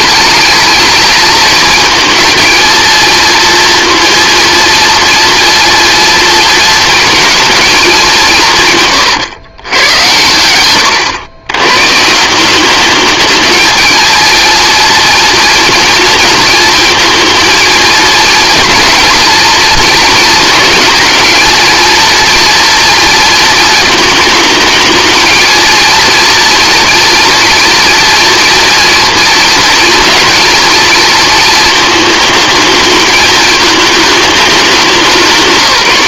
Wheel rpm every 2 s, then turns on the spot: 220, 230, 230, 230, 150, 100, 200, 230, 230, 220, 220, 230, 220, 230, 230, 230, 220, 200.
none